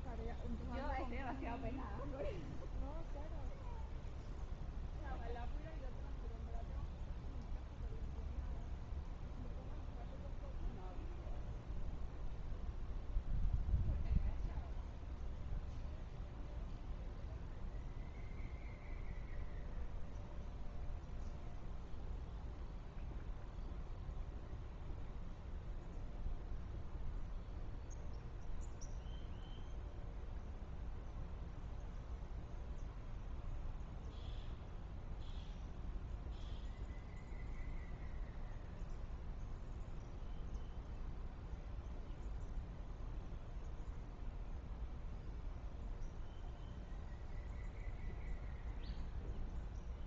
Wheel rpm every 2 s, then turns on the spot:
0, 0, 0, 0, 0, 0, 0, 0, 0, 0, 0, 0, 0, 0, 0, 0, 0, 0, 0, 0, 0, 0, 0, 0, 0.
none